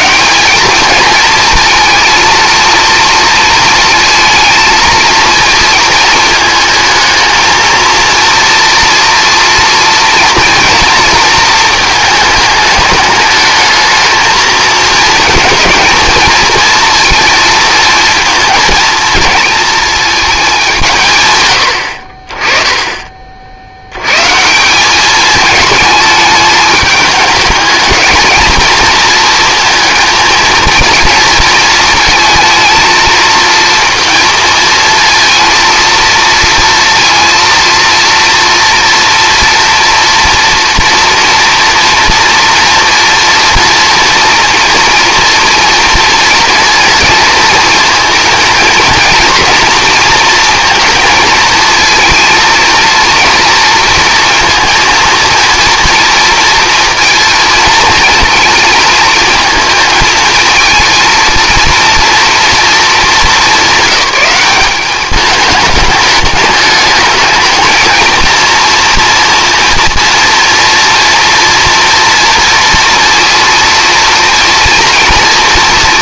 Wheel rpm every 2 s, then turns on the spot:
200, 230, 230, 220, 230, 230, 210, 220, 230, 230, 190, 20, 180, 220, 230, 230, 220, 220, 230, 230, 230, 230, 230, 230, 230, 220, 230, 230, 230, 230, 230, 230, 200, 210, 230, 230, 230, 230.
none